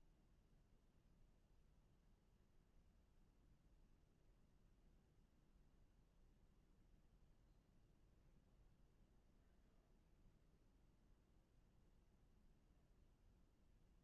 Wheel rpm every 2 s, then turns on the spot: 0, 0, 0, 0, 0, 0, 0.
none